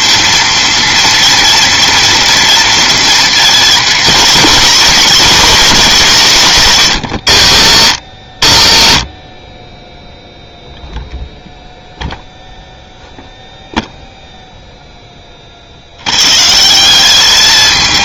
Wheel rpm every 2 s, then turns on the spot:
230, 230, 240, 180, 110, 0, 0, 0, 160.
none